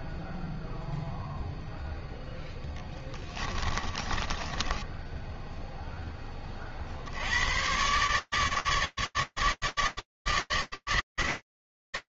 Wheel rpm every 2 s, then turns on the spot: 0, 20, 0, 120, 150, 160.
2-4